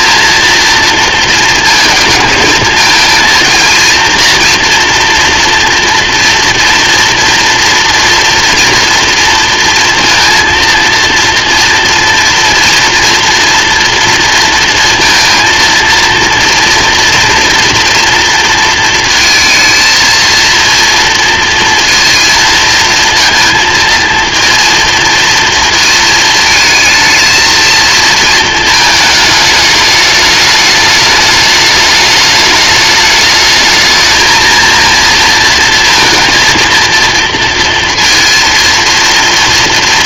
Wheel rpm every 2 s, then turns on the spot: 230, 220, 230, 230, 230, 230, 230, 230, 230, 230, 230, 230, 230, 220, 220, 210, 210, 230, 230, 230.
none